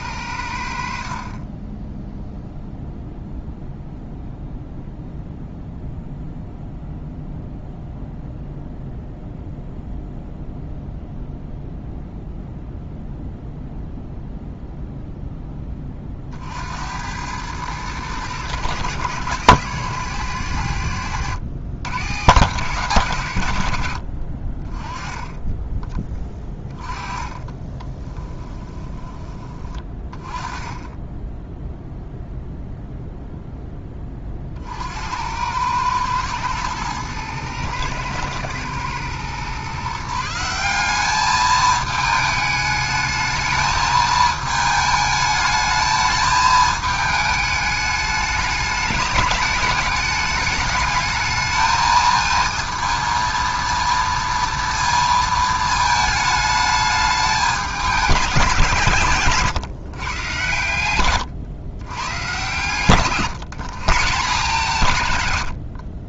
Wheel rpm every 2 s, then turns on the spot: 70, 0, 0, 0, 0, 0, 0, 0, 70, 110, 100, 120, 40, 20, 20, 20, 0, 50, 110, 110, 180, 210, 220, 220, 210, 210, 230, 230, 210, 160, 100, 120, 140.
26-30